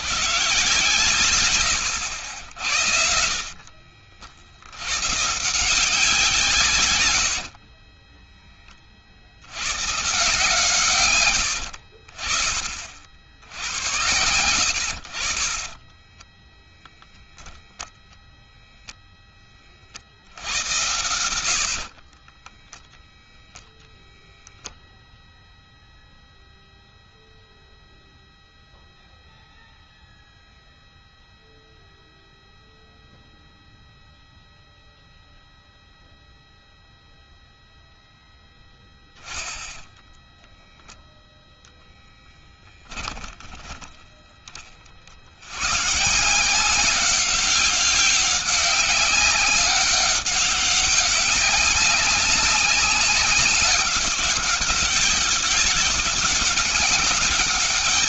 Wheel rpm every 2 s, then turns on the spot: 120, 80, 60, 150, 20, 150, 60, 90, 10, 0, 80, 20, 0, 0, 0, 0, 0, 0, 0, 0, 0, 10, 20, 160, 200, 200, 200, 190, 200.
16-18 22-24 42-44